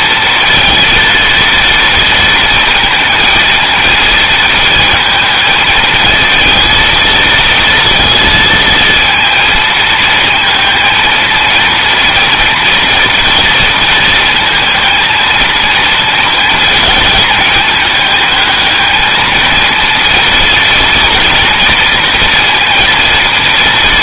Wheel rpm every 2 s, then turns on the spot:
230, 230, 220, 230, 230, 220, 230, 230, 220, 220, 230, 230.
none